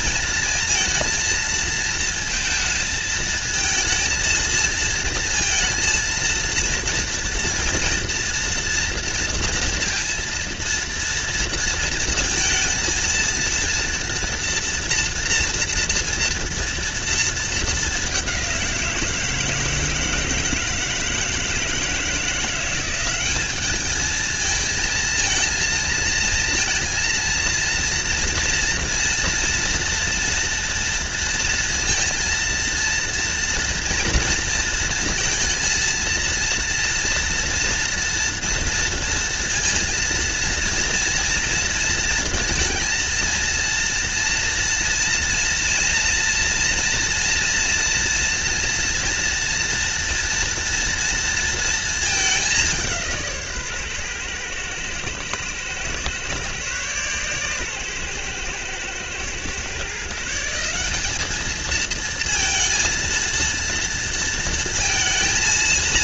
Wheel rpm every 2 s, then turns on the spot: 230, 220, 230, 230, 230, 230, 230, 230, 230, 170, 160, 190, 230, 230, 240, 230, 230, 230, 230, 230, 230, 230, 230, 240, 230, 230, 170, 110, 130, 120, 200, 230, 230.
none